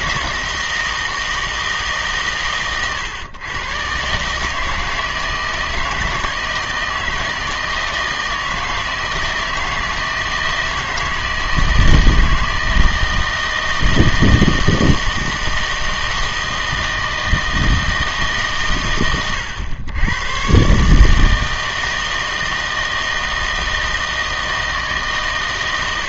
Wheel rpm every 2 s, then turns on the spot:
160, 120, 160, 160, 160, 160, 160, 160, 160, 140, 130, 160, 160.
none